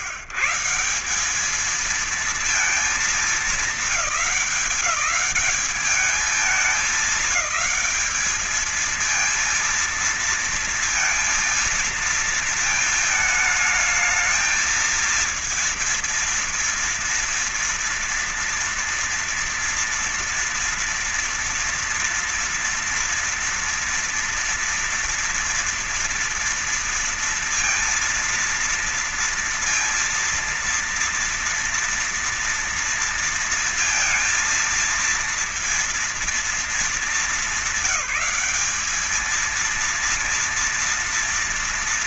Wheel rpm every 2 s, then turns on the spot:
150, 220, 210, 210, 220, 230, 230, 220, 230, 230, 240, 240, 230, 230, 230, 230, 230, 230, 230, 190, 230.
none